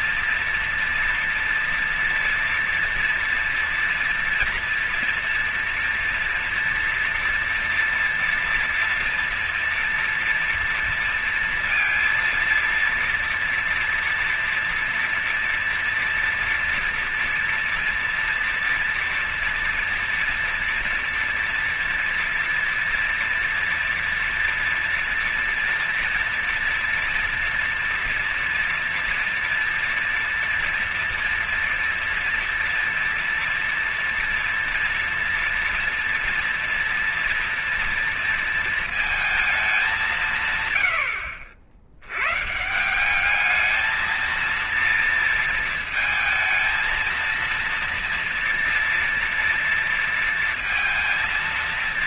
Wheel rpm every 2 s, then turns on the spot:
230, 230, 230, 230, 230, 230, 230, 230, 230, 230, 230, 240, 230, 230, 240, 230, 230, 230, 230, 230, 160, 90, 220, 230, 230, 230.
none